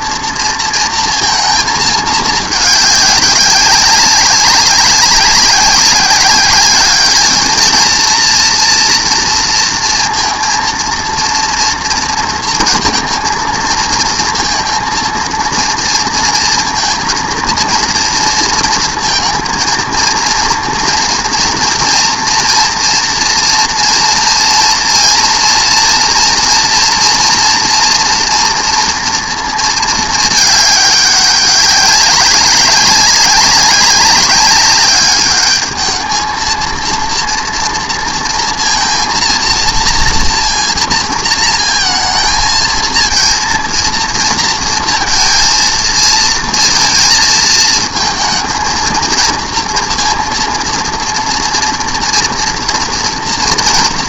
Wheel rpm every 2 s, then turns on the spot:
230, 210, 200, 200, 230, 230, 230, 230, 230, 230, 230, 230, 230, 230, 240, 210, 190, 200, 230, 230, 230, 220, 230, 230, 220, 230, 230.
none